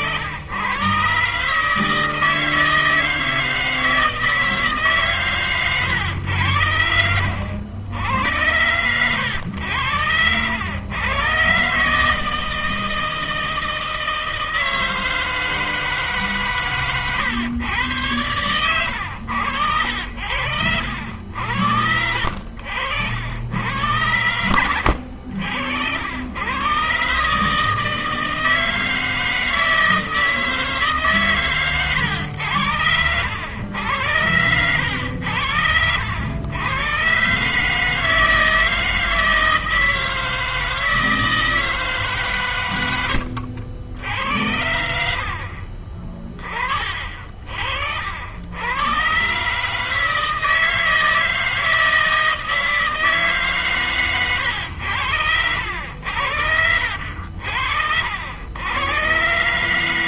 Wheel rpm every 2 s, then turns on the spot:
100, 160, 160, 90, 80, 90, 160, 160, 140, 100, 70, 70, 100, 90, 160, 160, 110, 100, 90, 160, 160, 150, 80, 30, 70, 160, 160, 120, 80, 70.
none